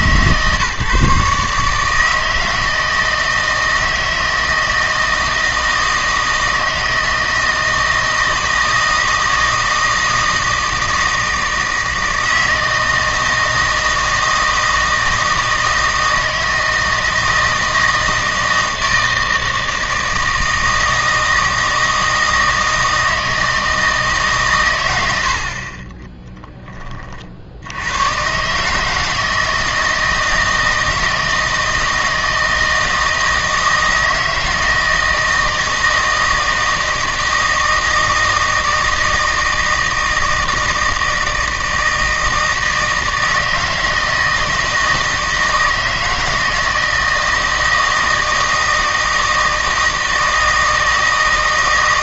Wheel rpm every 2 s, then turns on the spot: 150, 160, 160, 160, 160, 160, 160, 160, 160, 160, 160, 160, 110, 10, 150, 160, 160, 160, 160, 160, 160, 160, 160, 160, 160, 160.
none